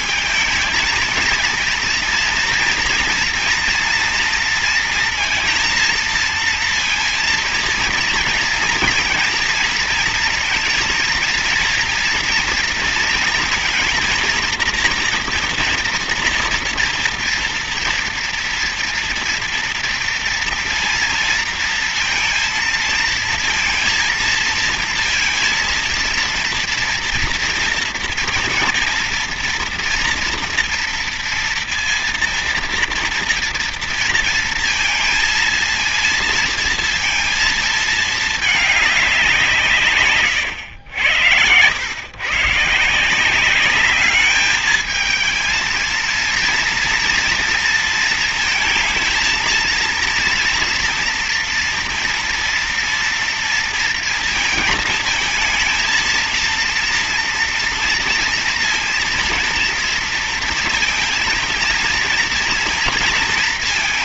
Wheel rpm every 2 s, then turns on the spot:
220, 230, 230, 230, 230, 230, 230, 230, 240, 230, 230, 230, 230, 230, 230, 240, 230, 230, 230, 210, 100, 130, 210, 230, 230, 230, 230, 220, 230, 230, 230, 230.
none